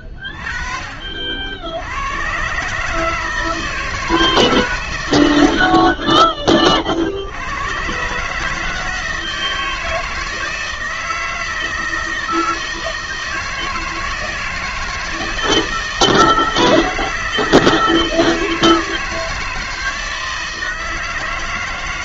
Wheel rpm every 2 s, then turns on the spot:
40, 140, 140, 40, 160, 160, 160, 160, 160, 160, 160.
none